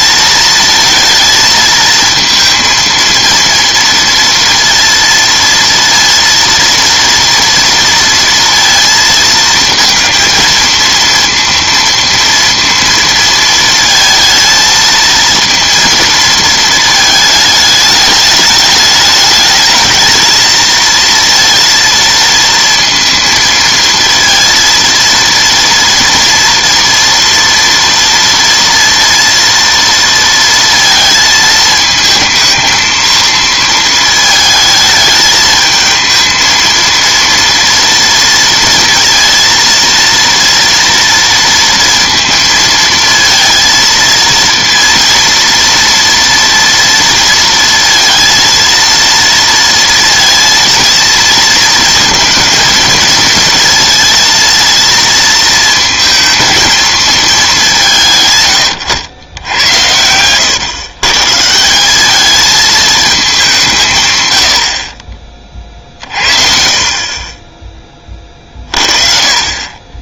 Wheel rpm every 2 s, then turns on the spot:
230, 230, 230, 230, 230, 230, 230, 230, 220, 210, 230, 230, 230, 230, 230, 230, 220, 220, 230, 230, 230, 230, 230, 230, 230, 230, 220, 230, 230, 120, 120, 220, 60, 50, 40.
none